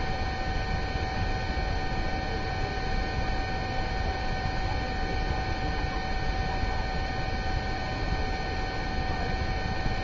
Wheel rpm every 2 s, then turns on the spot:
0, 0, 0, 0, 0.
none